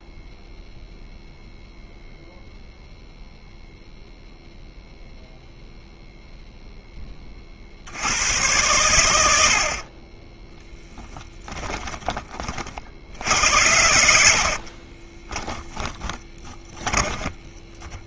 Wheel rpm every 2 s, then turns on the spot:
0, 0, 0, 0, 110, 10, 50, 30, 20.
10-12 14-18